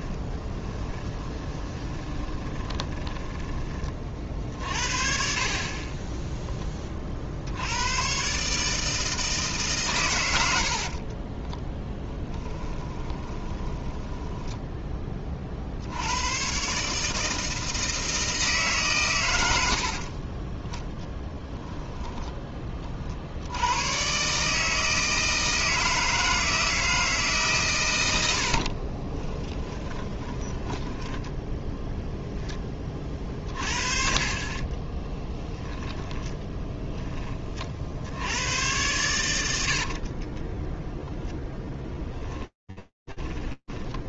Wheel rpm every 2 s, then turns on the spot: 20, 20, 50, 10, 130, 90, 20, 10, 120, 150, 30, 10, 140, 160, 70, 20, 10, 30, 10, 100, 20, 10.
0-4 12-16 20-22 28-32 34-38 40-44